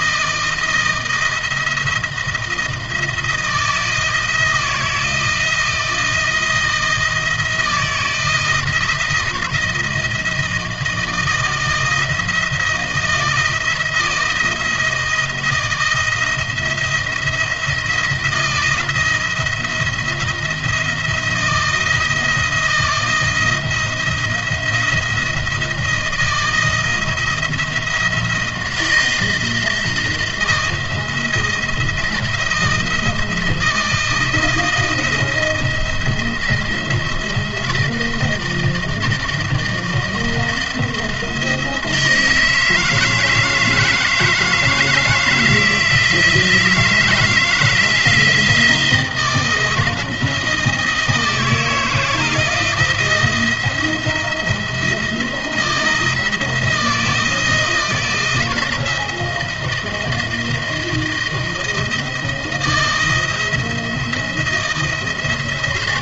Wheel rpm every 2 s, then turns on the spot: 170, 160, 160, 160, 160, 160, 160, 170, 170, 160, 170, 160, 170, 170, 170, 160, 160, 160, 170, 160, 170, 160, 160, 160, 170, 160, 170, 170, 160, 170, 160, 170, 170.
none